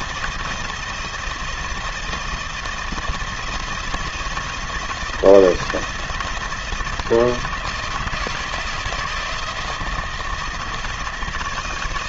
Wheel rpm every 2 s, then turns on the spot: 170, 170, 170, 160, 160, 160.
none